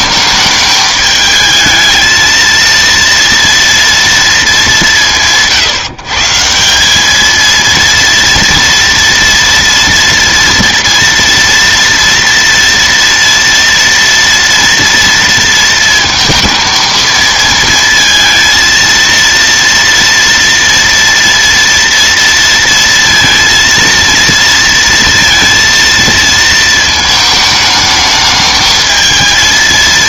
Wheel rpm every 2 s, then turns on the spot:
220, 230, 210, 170, 230, 230, 230, 230, 220, 230, 230, 230, 230, 230, 220.
none